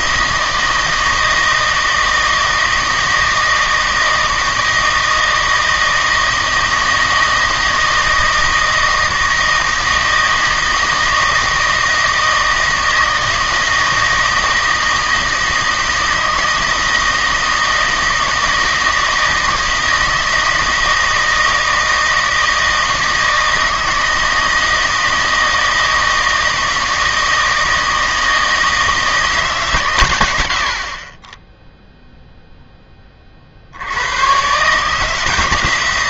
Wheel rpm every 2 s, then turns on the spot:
160, 160, 160, 160, 160, 160, 160, 160, 160, 160, 160, 160, 160, 160, 160, 60, 10, 140.
none